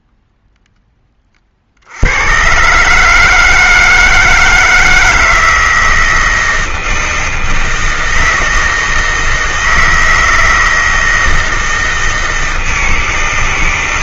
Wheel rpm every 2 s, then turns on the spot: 10, 130, 160, 160, 160, 160, 160.
none